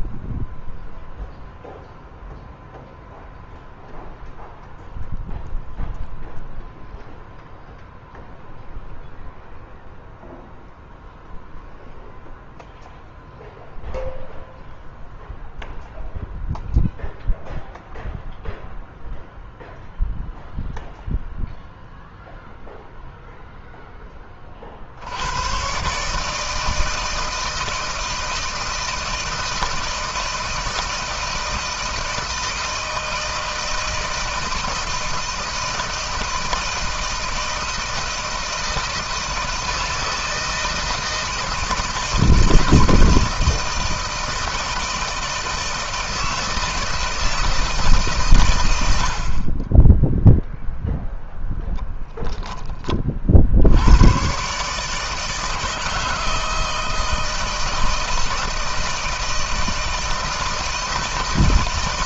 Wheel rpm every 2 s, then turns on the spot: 0, 0, 0, 0, 0, 0, 0, 0, 0, 0, 0, 0, 50, 160, 160, 160, 160, 160, 160, 160, 160, 160, 160, 160, 100, 0, 20, 140, 160, 160, 160.
none